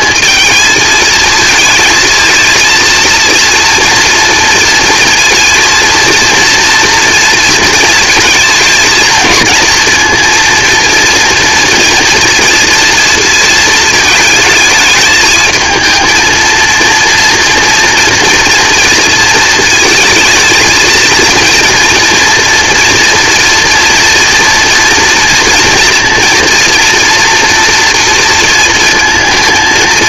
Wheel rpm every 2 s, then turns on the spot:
230, 230, 230, 230, 230, 230, 230, 220, 230, 230, 230, 230, 230, 230, 230.
none